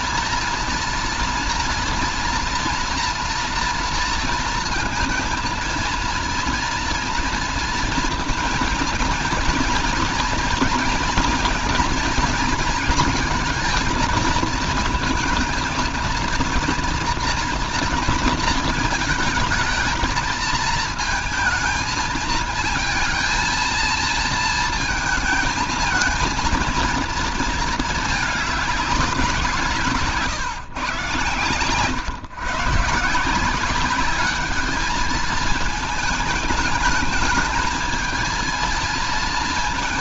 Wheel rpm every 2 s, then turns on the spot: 230, 230, 230, 230, 230, 230, 230, 220, 230, 220, 220, 220, 220, 220, 210, 150, 140, 210, 210, 220.
none